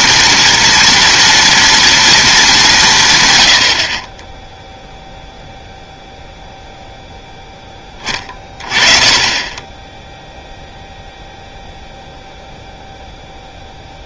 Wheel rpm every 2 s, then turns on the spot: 240, 190, 0, 0, 30, 0, 0.
none